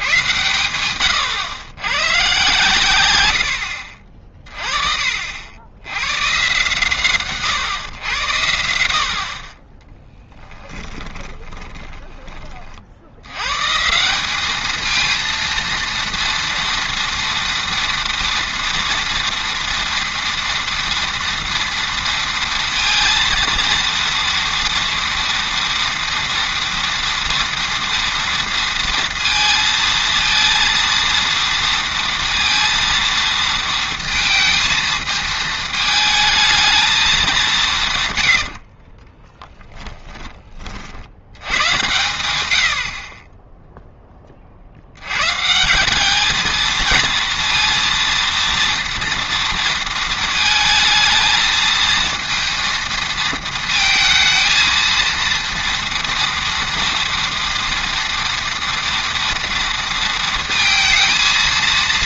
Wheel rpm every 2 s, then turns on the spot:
110, 130, 30, 130, 80, 10, 40, 210, 230, 230, 230, 230, 230, 230, 230, 230, 230, 230, 220, 50, 40, 90, 60, 220, 230, 220, 230, 230, 230, 230, 230.
10-12 38-40